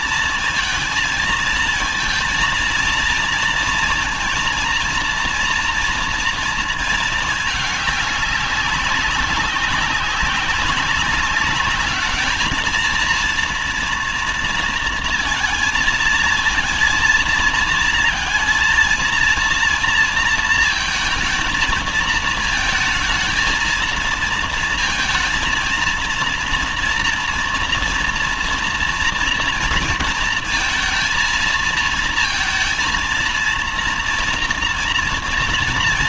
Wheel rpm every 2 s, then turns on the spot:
220, 230, 230, 230, 190, 190, 230, 230, 230, 230, 230, 220, 230, 230, 230, 230, 230, 240.
none